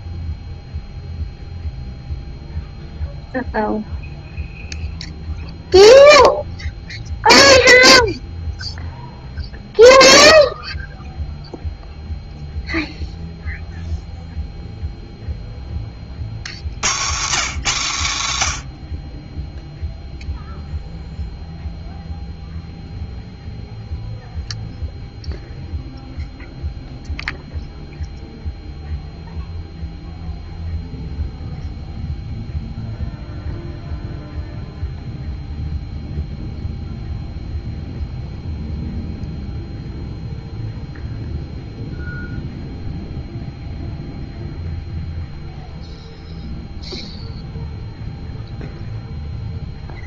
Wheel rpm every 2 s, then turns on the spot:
0, 0, 0, 0, 0, 0, 0, 0, 110, 60, 0, 0, 0, 0, 0, 0, 0, 0, 0, 0, 0, 0, 0, 0, 0.
none